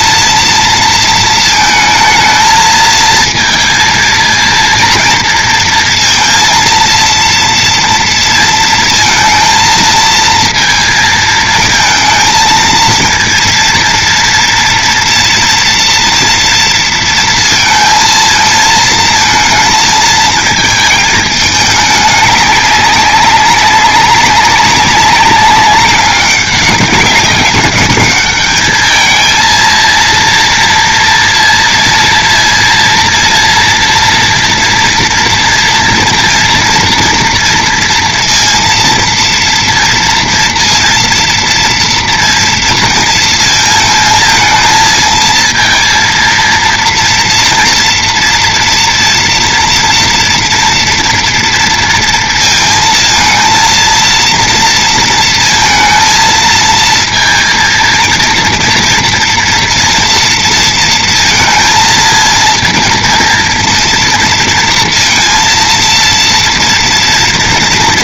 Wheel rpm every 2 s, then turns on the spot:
230, 220, 230, 230, 230, 230, 230, 230, 230, 230, 220, 200, 200, 200, 210, 230, 230, 230, 230, 230, 230, 230, 220, 230, 230, 230, 230, 230, 230, 230, 230, 230, 230, 230.
none